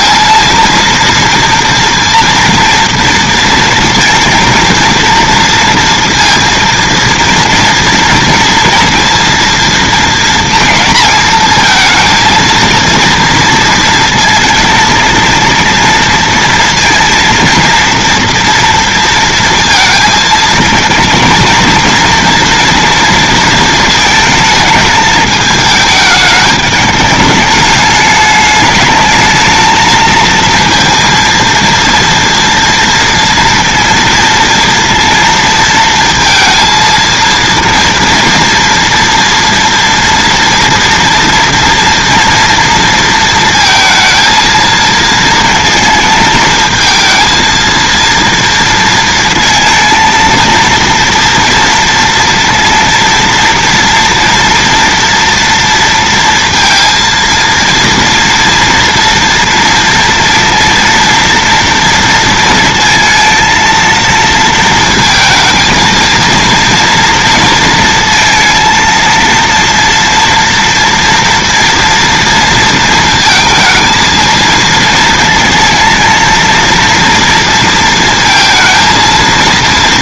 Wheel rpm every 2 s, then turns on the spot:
230, 230, 230, 230, 230, 220, 230, 220, 230, 230, 230, 230, 220, 210, 210, 230, 230, 230, 230, 230, 230, 230, 220, 220, 230, 230, 230, 230, 230, 230, 230, 230, 230, 230, 230, 230, 230, 220, 230, 230.
none